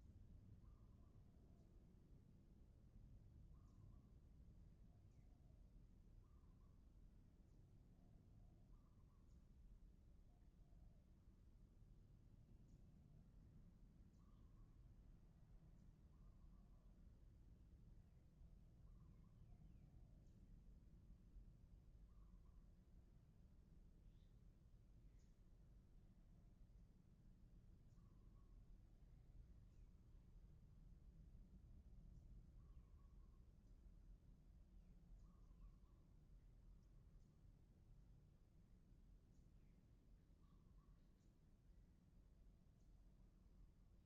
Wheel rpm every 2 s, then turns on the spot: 0, 0, 0, 0, 0, 0, 0, 0, 0, 0, 0, 0, 0, 0, 0, 0, 0, 0, 0, 0, 0, 0.
none